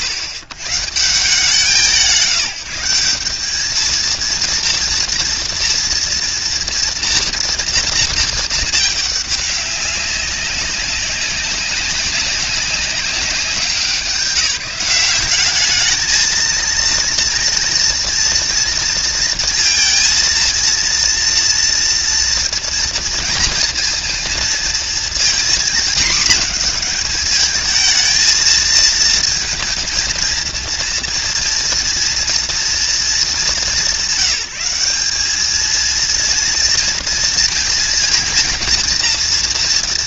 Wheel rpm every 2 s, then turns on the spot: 80, 170, 230, 230, 210, 190, 190, 180, 230, 230, 230, 230, 230, 230, 230, 230, 230, 180, 230, 230.
none